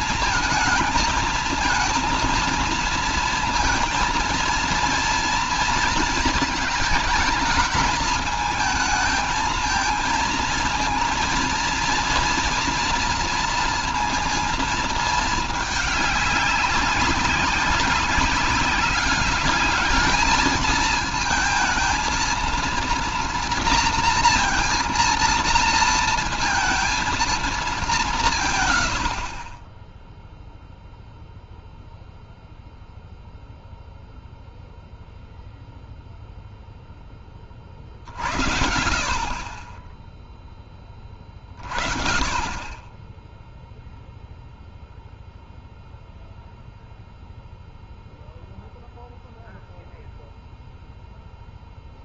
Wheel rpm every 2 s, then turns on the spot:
220, 230, 230, 220, 220, 230, 230, 230, 200, 200, 220, 230, 230, 230, 130, 0, 0, 0, 0, 60, 20, 20, 0, 0, 0, 0.
none